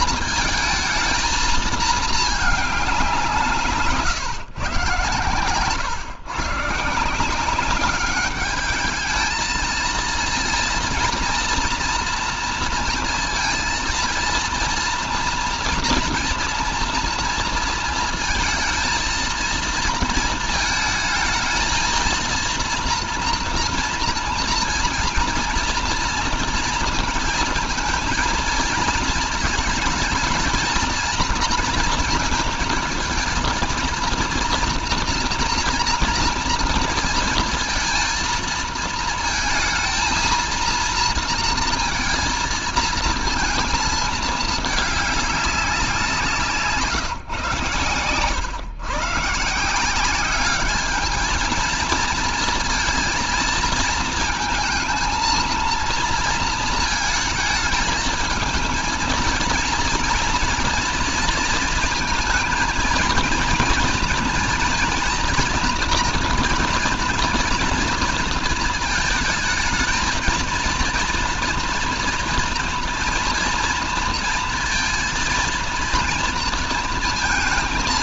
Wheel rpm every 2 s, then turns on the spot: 230, 210, 140, 150, 210, 230, 230, 230, 230, 220, 220, 230, 240, 230, 230, 220, 230, 230, 230, 230, 230, 230, 210, 170, 120, 210, 230, 220, 230, 220, 230, 230, 230, 240, 230, 230, 230, 230, 220.
none